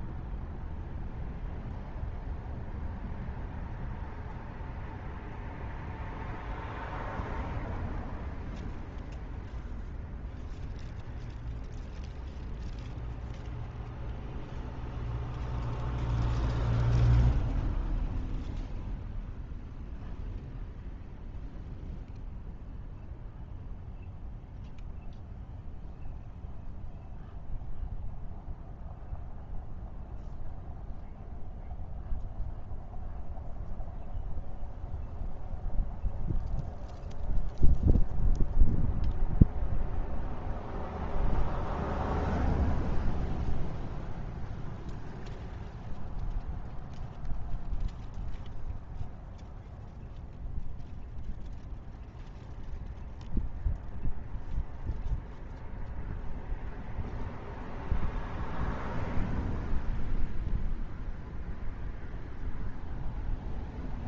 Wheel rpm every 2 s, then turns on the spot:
0, 0, 0, 0, 0, 0, 0, 0, 0, 0, 0, 0, 0, 0, 0, 0, 0, 0, 0, 0, 0, 0, 0, 0, 0, 0, 0, 0, 0, 0, 0, 0.
none